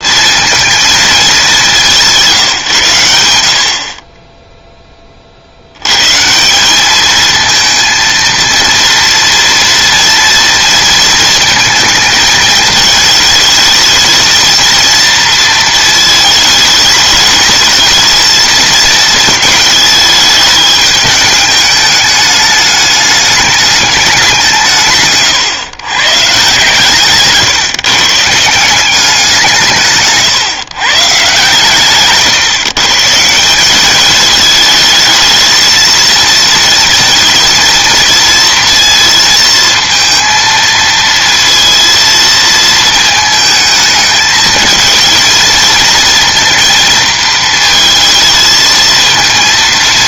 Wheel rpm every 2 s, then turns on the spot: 220, 120, 10, 200, 230, 230, 220, 230, 220, 220, 210, 210, 150, 140, 180, 140, 140, 220, 230, 230, 230, 230, 220, 220, 220.
none